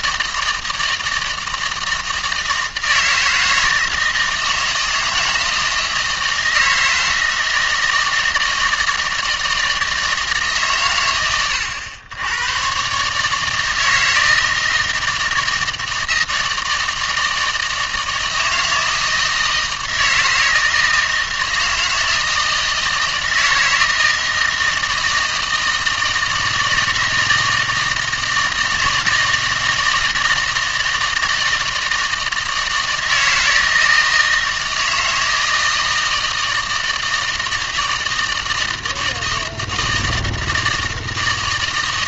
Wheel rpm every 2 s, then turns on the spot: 160, 160, 160, 160, 160, 130, 120, 160, 160, 160, 160, 160, 160, 160, 160, 160, 160, 160, 160, 160, 160.
none